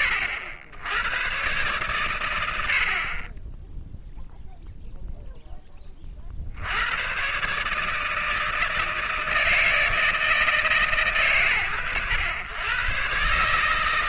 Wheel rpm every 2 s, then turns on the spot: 90, 70, 0, 60, 160, 160, 100.
none